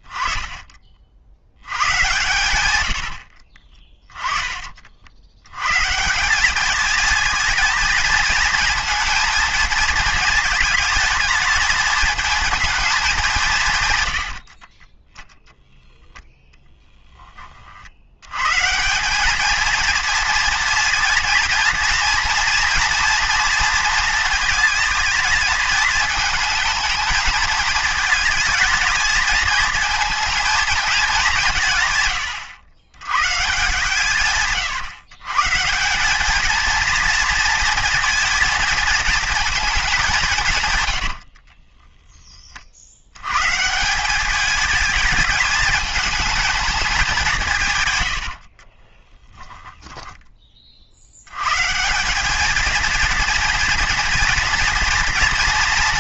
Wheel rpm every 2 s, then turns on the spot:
20, 110, 30, 210, 230, 220, 230, 50, 10, 150, 230, 230, 220, 220, 220, 230, 100, 140, 220, 230, 150, 50, 220, 220, 50, 30, 220, 230.
14-16 48-50